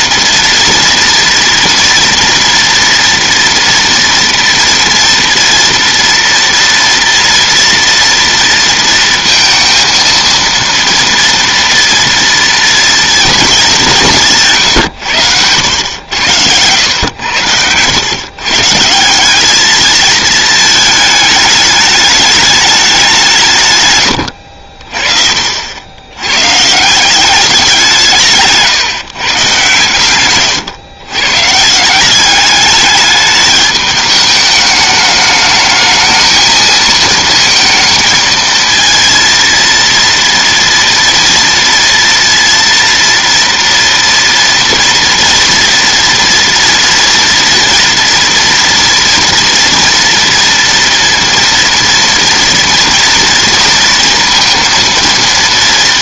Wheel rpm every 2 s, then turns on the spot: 230, 230, 230, 230, 230, 230, 230, 120, 100, 150, 220, 200, 40, 160, 140, 120, 210, 210, 220, 230, 240, 230, 230, 230, 230, 230, 240, 230.
none